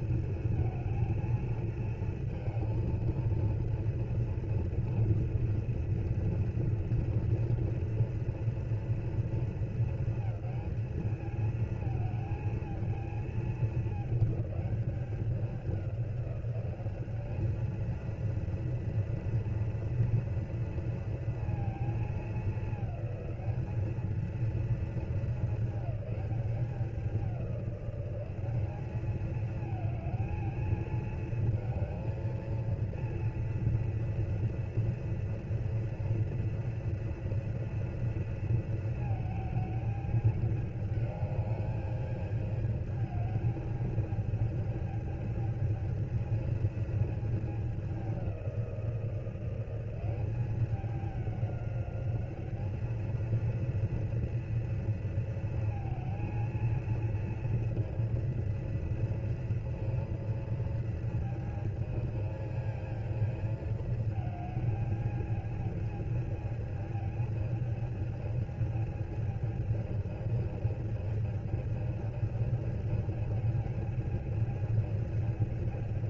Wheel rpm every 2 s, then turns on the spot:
230, 230, 230, 230, 230, 220, 220, 210, 190, 230, 230, 210, 220, 200, 190, 220, 230, 230, 230, 220, 210, 210, 220, 220, 180, 200, 210, 230, 230, 230, 230, 220, 220, 220, 220, 220, 220, 220.
none